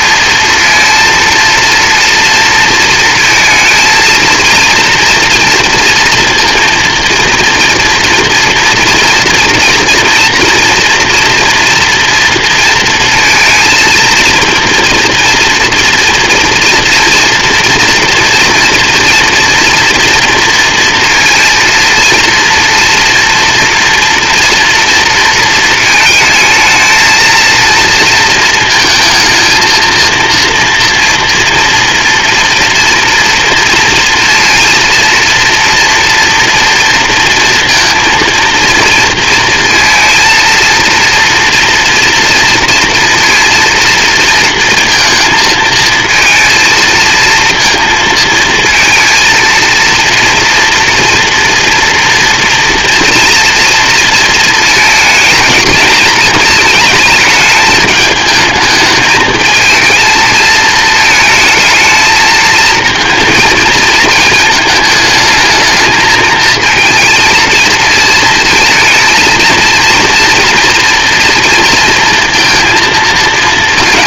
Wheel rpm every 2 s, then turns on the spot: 230, 230, 230, 230, 230, 230, 230, 230, 240, 230, 230, 230, 230, 220, 230, 230, 230, 230, 230, 230, 240, 230, 220, 230, 230, 240, 230, 220, 210, 220, 220, 230, 220, 220, 230, 230, 230.
none